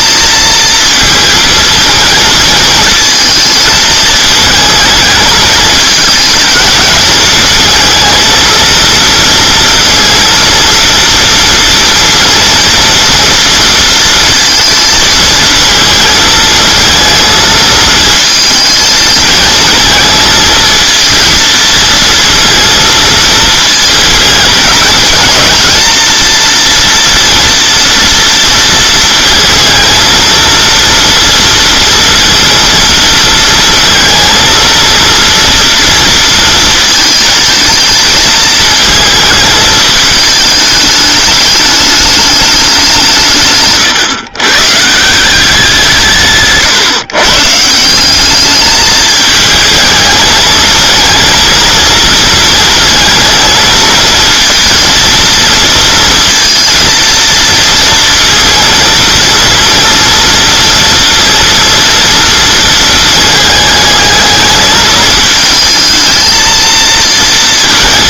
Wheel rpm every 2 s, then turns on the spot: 230, 220, 220, 220, 230, 230, 230, 230, 230, 220, 230, 230, 230, 230, 230, 230, 230, 230, 230, 220, 210, 190, 140, 140, 210, 230, 220, 230, 230, 230, 230, 220, 220, 220.
none